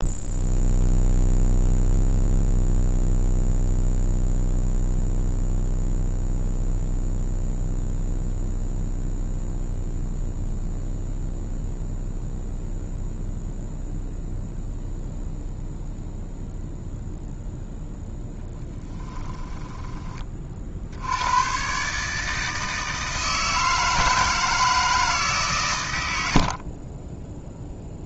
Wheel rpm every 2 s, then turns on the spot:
0, 0, 0, 0, 0, 0, 0, 0, 0, 10, 50, 160, 160, 30.
18-20